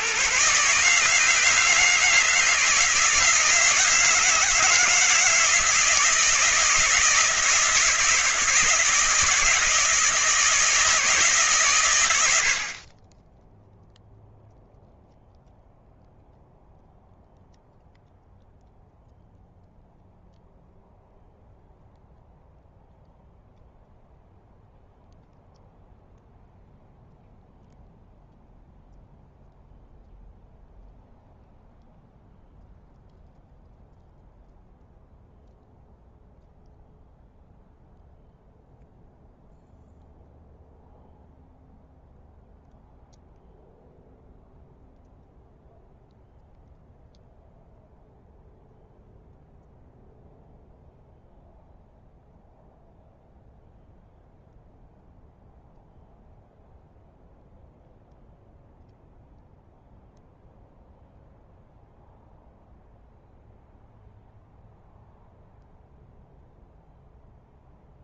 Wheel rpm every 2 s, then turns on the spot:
150, 160, 160, 160, 160, 160, 20, 0, 0, 0, 0, 0, 0, 0, 0, 0, 0, 0, 0, 0, 0, 0, 0, 0, 0, 0, 0, 0, 0, 0, 0, 0, 0, 0.
none